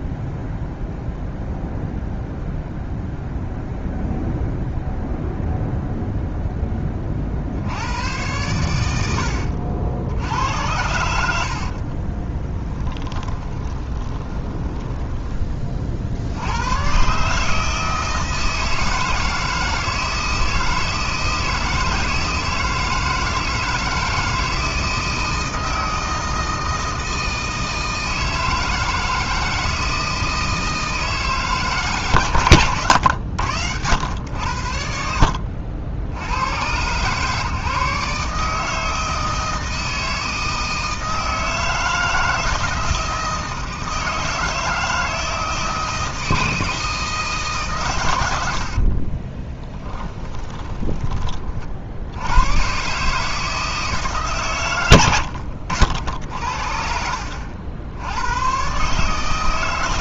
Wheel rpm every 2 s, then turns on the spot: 0, 0, 0, 20, 100, 90, 10, 10, 110, 160, 160, 160, 160, 160, 160, 160, 120, 80, 120, 160, 160, 160, 160, 160, 60, 20, 130, 120, 60, 130.
12-16 48-52 56-58